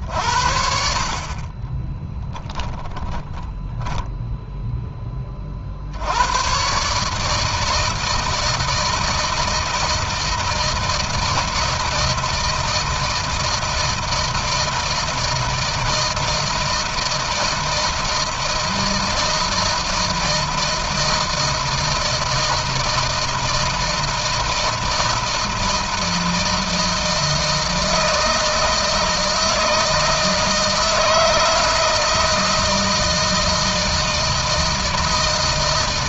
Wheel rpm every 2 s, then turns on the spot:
60, 10, 0, 100, 160, 160, 160, 160, 160, 160, 160, 160, 160, 160, 160, 160, 160, 160.
2-4